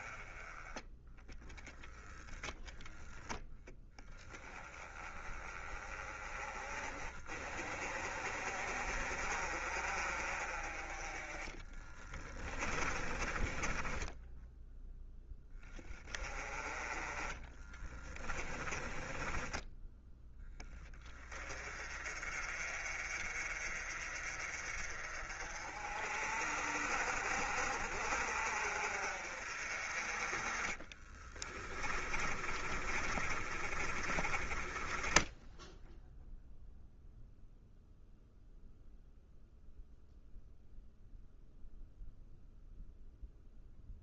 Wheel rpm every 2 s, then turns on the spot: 20, 0, 20, 20, 40, 30, 20, 0, 20, 20, 10, 40, 40, 50, 50, 20, 40, 20, 0, 0, 0, 0.
12-14 18-20 30-36